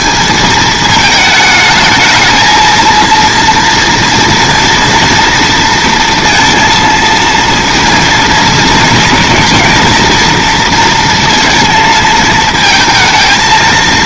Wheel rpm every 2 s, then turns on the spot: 220, 230, 240, 230, 230, 230, 230.
none